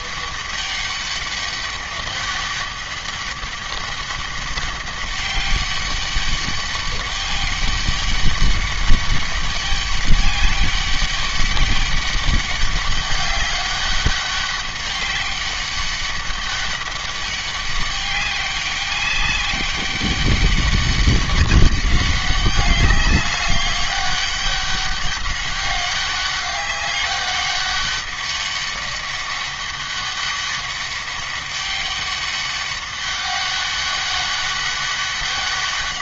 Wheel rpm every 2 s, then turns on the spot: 200, 200, 190, 200, 200, 200, 200, 200, 200, 200, 200, 200, 200, 200, 200, 200, 200, 200.
none